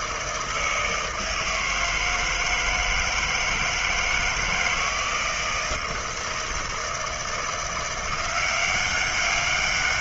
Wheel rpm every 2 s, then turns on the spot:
160, 160, 160, 160, 180.
none